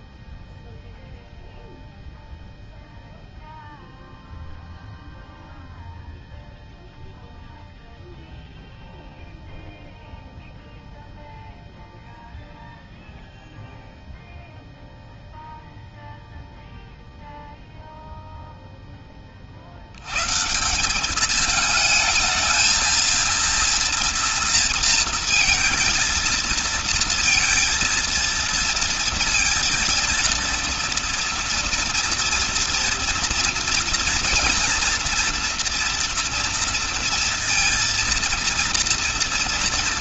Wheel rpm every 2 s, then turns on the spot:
0, 0, 0, 0, 0, 0, 0, 0, 0, 10, 180, 230, 230, 230, 230, 230, 230, 230, 230, 230.
none